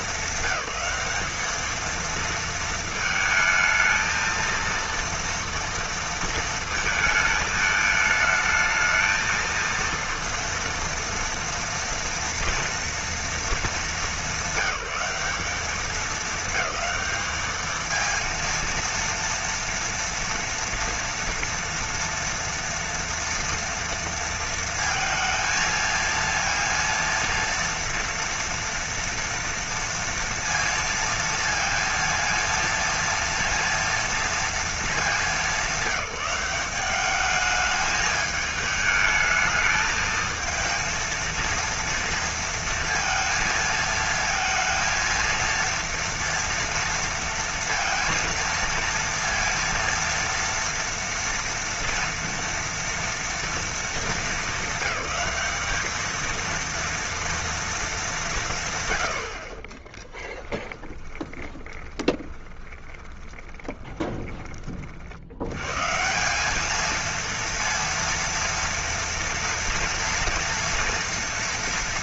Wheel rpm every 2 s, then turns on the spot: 200, 230, 230, 220, 220, 230, 230, 210, 220, 230, 230, 230, 230, 230, 230, 230, 230, 230, 190, 220, 220, 230, 230, 230, 230, 230, 230, 210, 230, 170, 10, 20, 20, 180, 230, 230.
60-66